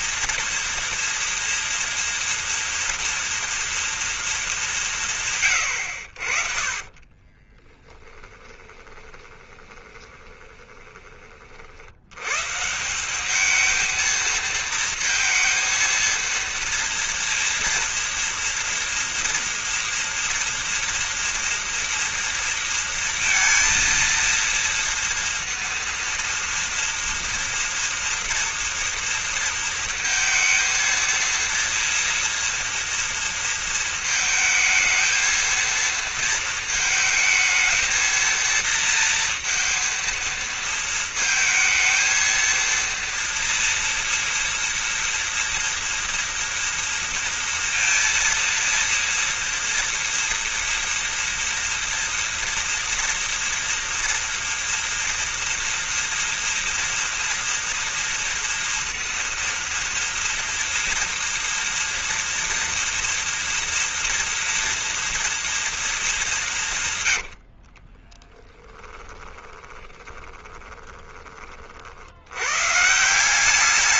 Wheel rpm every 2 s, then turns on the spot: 230, 230, 170, 30, 20, 20, 180, 230, 230, 230, 230, 230, 230, 230, 230, 230, 230, 220, 220, 230, 220, 230, 240, 230, 230, 240, 230, 240, 230, 230, 230, 230, 230, 140, 10, 20, 150.
6-10 66-70